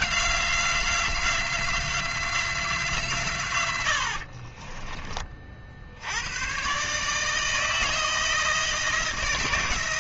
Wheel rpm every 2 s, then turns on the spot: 180, 170, 50, 120, 160.
4-6